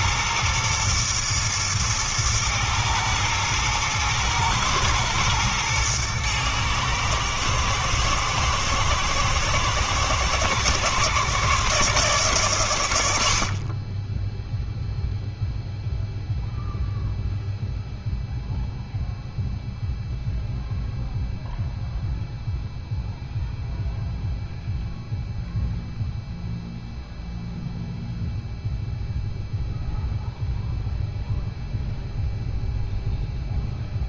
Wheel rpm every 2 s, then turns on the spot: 120, 110, 110, 110, 110, 110, 90, 0, 0, 0, 0, 0, 0, 0, 0, 0, 0.
none